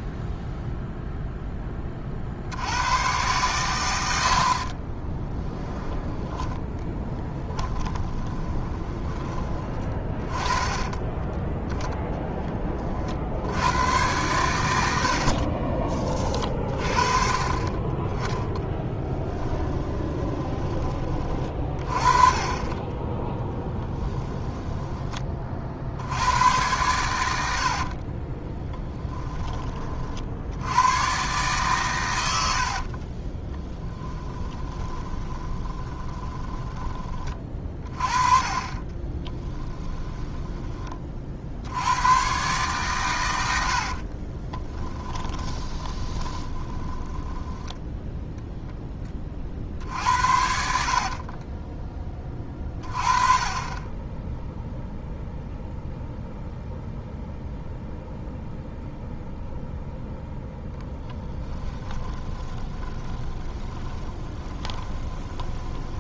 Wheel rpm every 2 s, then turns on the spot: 0, 80, 30, 10, 10, 20, 30, 100, 40, 0, 20, 20, 10, 100, 10, 100, 60, 20, 20, 30, 20, 130, 20, 30, 0, 70, 30, 0, 0, 0, 0, 20, 20.
4-10 22-26 28-30 32-36 38-40 44-48 50-52 62-66